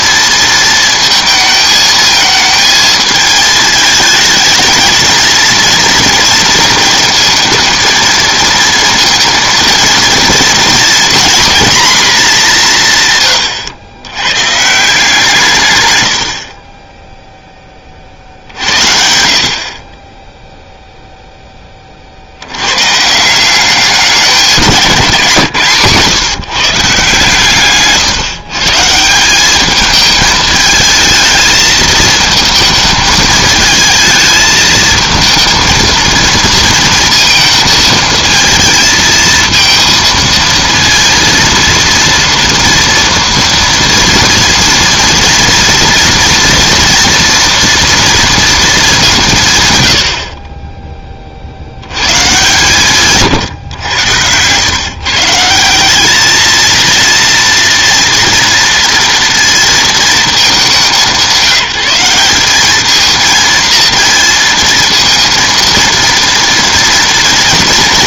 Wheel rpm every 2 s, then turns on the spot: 220, 220, 230, 230, 230, 230, 130, 170, 10, 60, 0, 120, 180, 150, 150, 220, 220, 220, 230, 220, 230, 230, 230, 240, 200, 10, 150, 130, 230, 230, 190, 210, 230, 230.
none